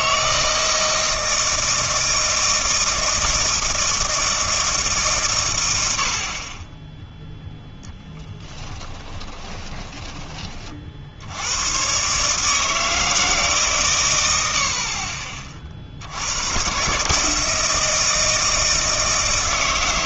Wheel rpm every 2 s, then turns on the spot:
160, 160, 150, 10, 20, 40, 160, 60, 120, 160.
8-10